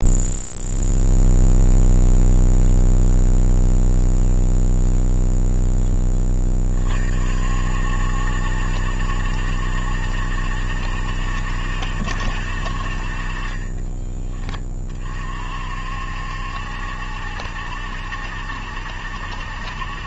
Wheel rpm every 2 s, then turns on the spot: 0, 0, 0, 40, 70, 70, 50, 30, 70, 70.
none